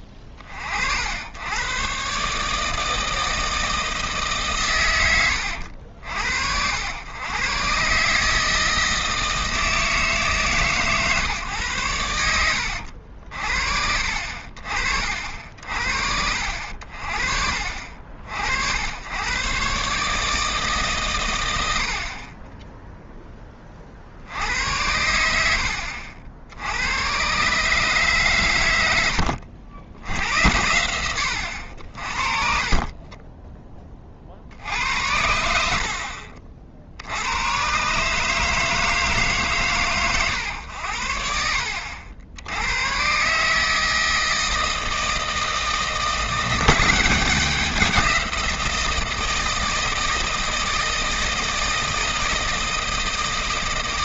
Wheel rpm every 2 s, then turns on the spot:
50, 150, 130, 80, 160, 150, 90, 50, 60, 80, 150, 20, 80, 80, 110, 90, 40, 60, 70, 160, 100, 90, 160, 180, 170, 160, 160.
32-34